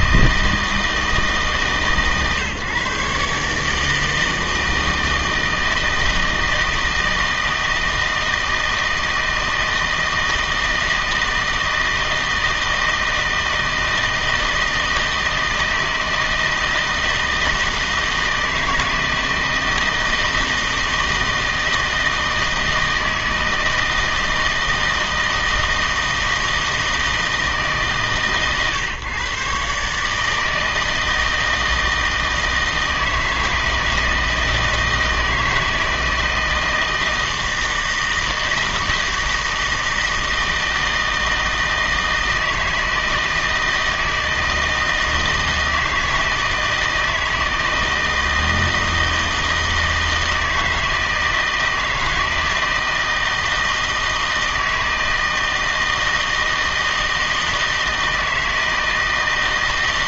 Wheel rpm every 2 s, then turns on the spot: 160, 140, 160, 160, 160, 160, 160, 160, 160, 170, 160, 160, 160, 160, 130, 160, 160, 160, 160, 160, 160, 160, 160, 160, 160, 160, 160, 160, 160, 160.
none